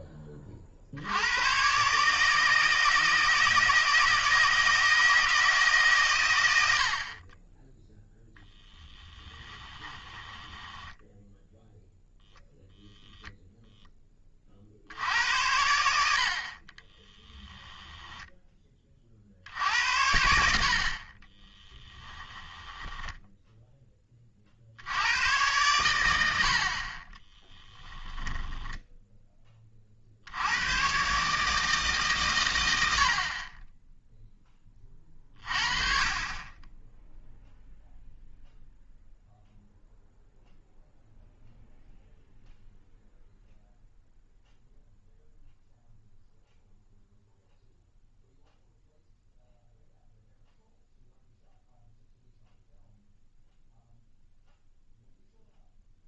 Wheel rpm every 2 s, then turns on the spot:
60, 160, 160, 60, 0, 10, 0, 60, 30, 30, 60, 10, 70, 60, 10, 120, 90, 20, 10, 0, 0, 0, 0, 0, 0, 0, 0, 0.
10-12 16-18 22-24 28-30